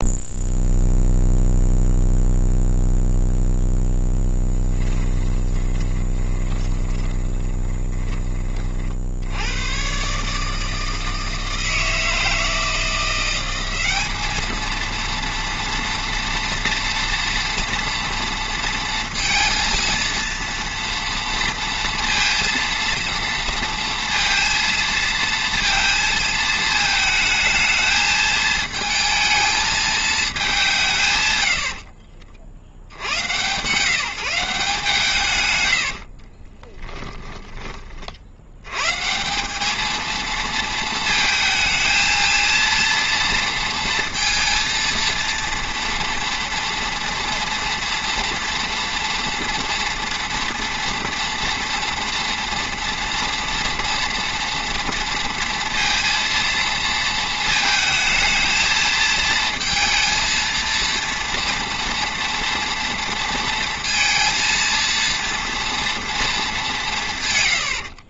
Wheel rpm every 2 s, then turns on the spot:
0, 0, 10, 20, 40, 160, 170, 220, 230, 230, 230, 230, 230, 220, 220, 190, 70, 170, 20, 110, 220, 230, 230, 230, 230, 240, 240, 230, 230, 230, 230, 230, 230, 200.
4-8 36-38